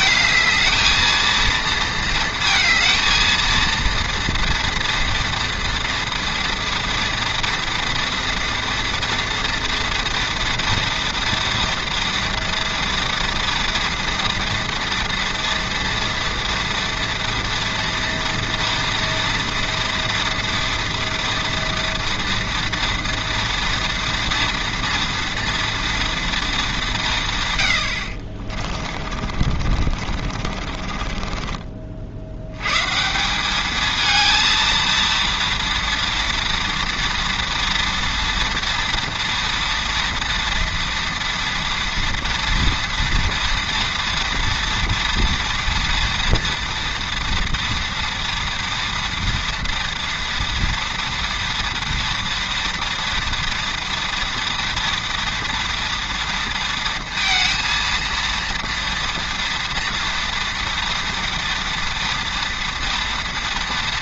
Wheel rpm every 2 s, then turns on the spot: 220, 230, 230, 240, 230, 230, 230, 230, 230, 230, 230, 230, 230, 220, 40, 40, 110, 230, 230, 230, 230, 230, 230, 230, 230, 230, 230, 230, 230, 230, 230, 230.
28-32